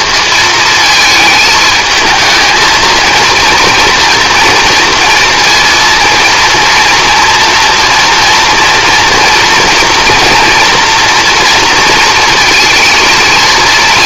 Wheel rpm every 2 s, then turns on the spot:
220, 220, 230, 230, 230, 230, 220.
none